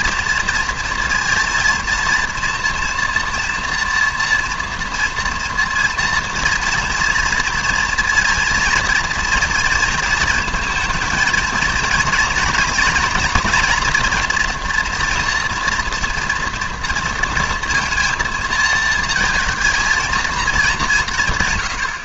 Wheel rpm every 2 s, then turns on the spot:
230, 230, 240, 230, 230, 230, 230, 240, 230, 230, 200.
none